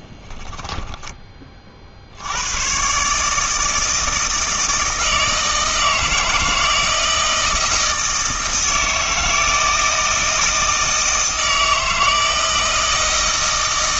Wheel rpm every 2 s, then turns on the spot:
10, 110, 160, 160, 160, 160, 160.
0-2